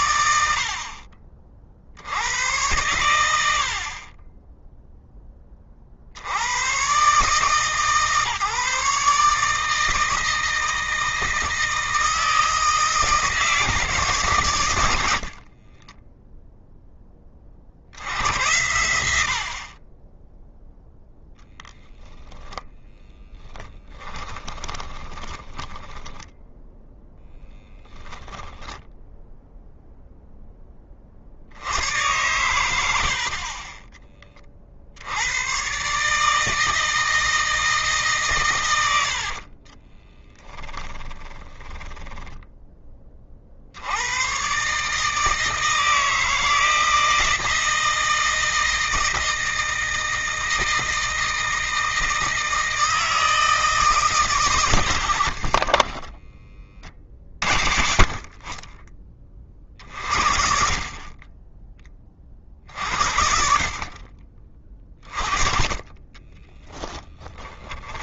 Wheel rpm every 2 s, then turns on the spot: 50, 110, 0, 130, 150, 160, 160, 100, 10, 90, 0, 10, 20, 10, 0, 10, 90, 70, 160, 100, 30, 20, 150, 160, 160, 160, 160, 110, 30, 40, 40, 50, 30, 10.
24-26 38-42 54-56 66-68